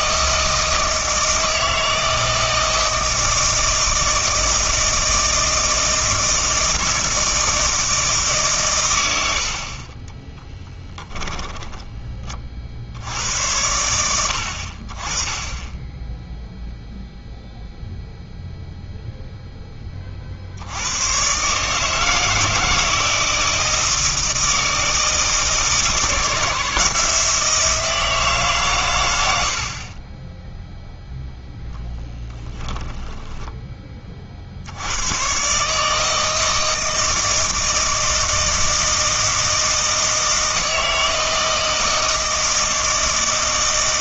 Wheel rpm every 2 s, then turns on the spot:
160, 160, 160, 160, 130, 10, 50, 60, 0, 0, 60, 160, 160, 160, 140, 0, 10, 60, 160, 160, 160, 160.
10-12 32-34